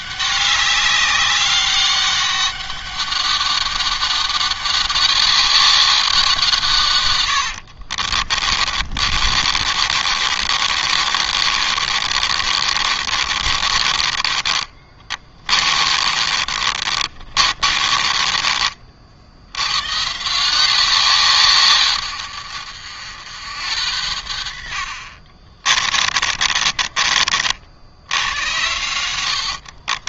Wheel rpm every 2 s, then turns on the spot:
200, 200, 200, 130, 40, 40, 40, 30, 40, 50, 170, 80, 50, 30, 80.
6-18 24-30